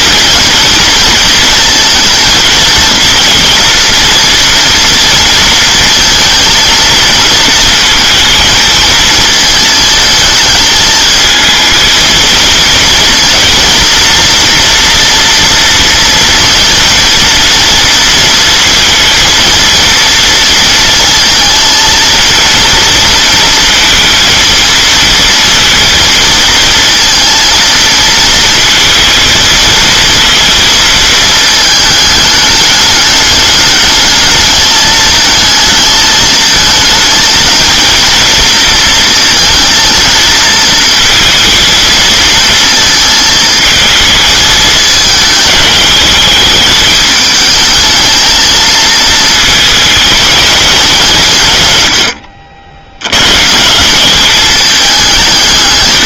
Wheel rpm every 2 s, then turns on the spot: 230, 230, 230, 230, 230, 220, 230, 230, 230, 230, 230, 230, 230, 230, 220, 230, 210, 210, 220, 230, 220, 230, 220, 210, 220, 210, 70, 200.
none